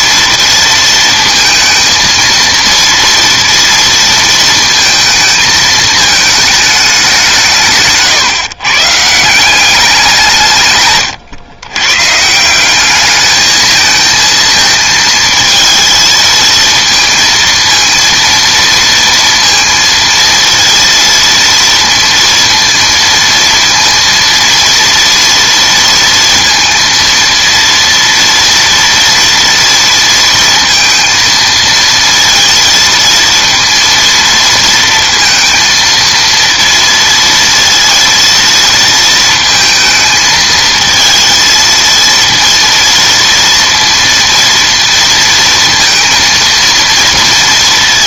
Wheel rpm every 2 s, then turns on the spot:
230, 230, 220, 210, 140, 140, 190, 220, 230, 230, 230, 230, 240, 230, 230, 230, 230, 230, 230, 230, 220, 230, 230, 230.
none